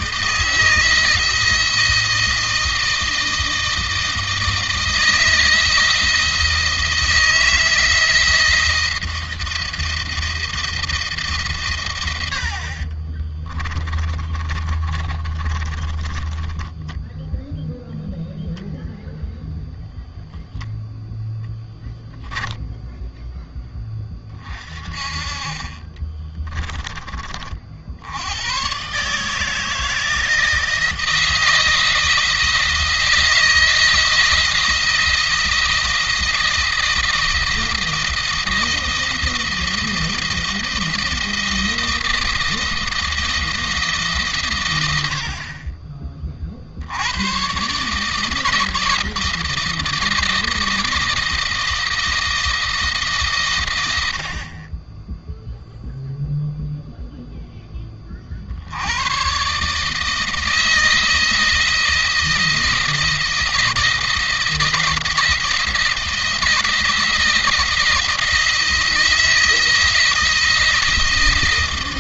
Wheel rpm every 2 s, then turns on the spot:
160, 160, 160, 160, 160, 160, 50, 30, 10, 0, 0, 10, 30, 20, 120, 160, 160, 170, 160, 170, 160, 160, 90, 60, 160, 160, 160, 30, 0, 100, 160, 160, 160, 160, 160, 160.
12-18 22-24